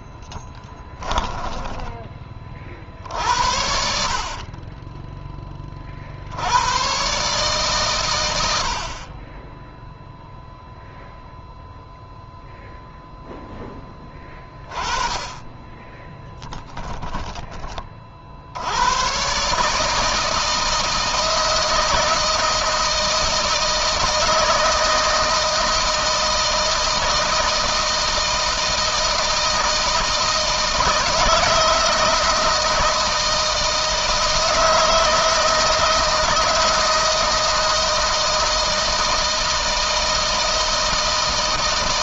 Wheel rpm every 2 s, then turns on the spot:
10, 60, 20, 130, 40, 0, 0, 20, 10, 120, 160, 160, 160, 160, 160, 160, 160, 160, 160, 160, 160.
0-2